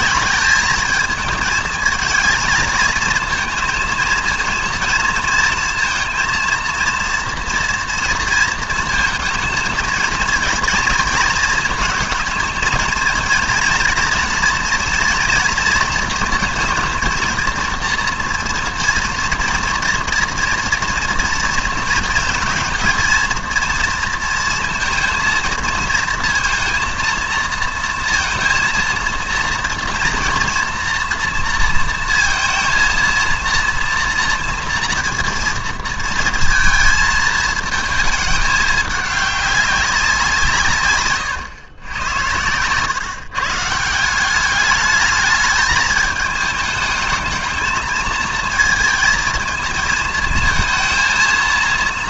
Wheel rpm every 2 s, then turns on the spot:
200, 230, 230, 230, 230, 230, 230, 230, 230, 230, 230, 230, 230, 230, 230, 240, 230, 230, 230, 210, 160, 110, 200, 210, 220, 220.
none